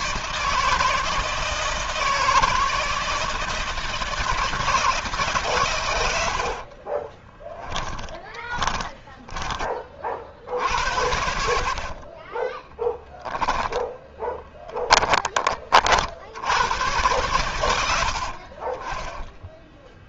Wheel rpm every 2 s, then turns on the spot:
160, 160, 100, 10, 40, 60, 10, 30, 80, 10.
4-8 10-14 18-20